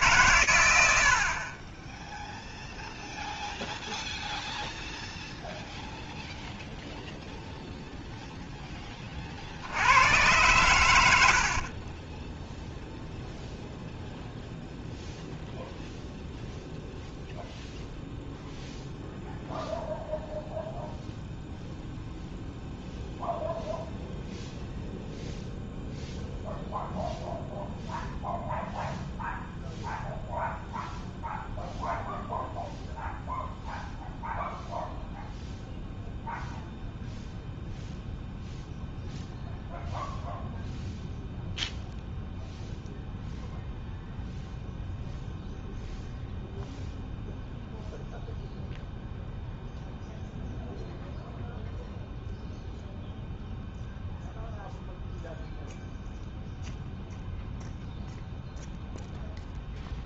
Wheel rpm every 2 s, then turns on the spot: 30, 0, 0, 0, 40, 80, 0, 0, 0, 0, 0, 0, 0, 0, 0, 0, 0, 0, 0, 0, 0, 0, 0, 0, 0, 0, 0, 0, 0, 0.
10-12